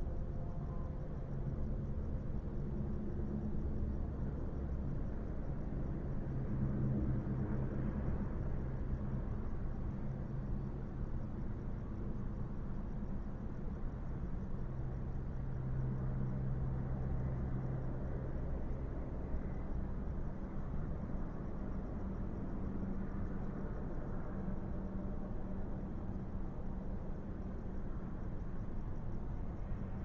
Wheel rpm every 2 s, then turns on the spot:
0, 0, 0, 0, 0, 0, 0, 0, 0, 0, 0, 0, 0, 0, 0.
none